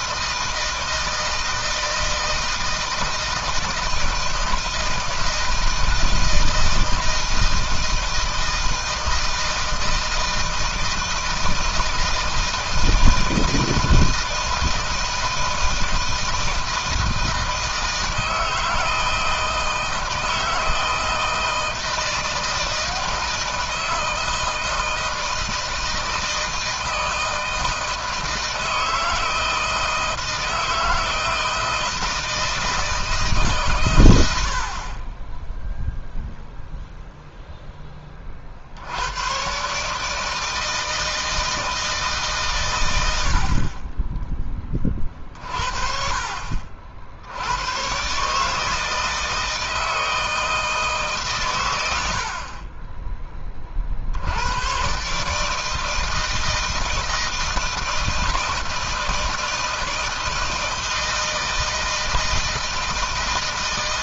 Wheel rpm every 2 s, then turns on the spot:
160, 160, 160, 160, 160, 160, 160, 160, 160, 160, 160, 160, 160, 160, 160, 160, 160, 80, 0, 50, 160, 120, 20, 60, 150, 160, 50, 100, 160, 160, 160, 160.
none